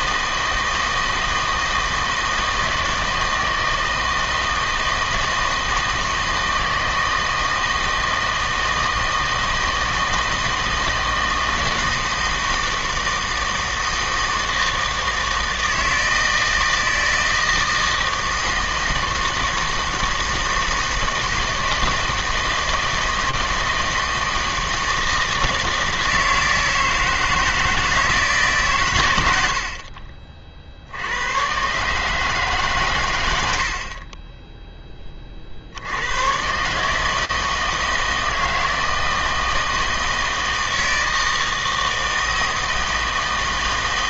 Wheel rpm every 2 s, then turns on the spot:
160, 160, 160, 160, 160, 160, 160, 160, 160, 160, 160, 160, 160, 160, 140, 50, 150, 10, 130, 160, 160, 160.
none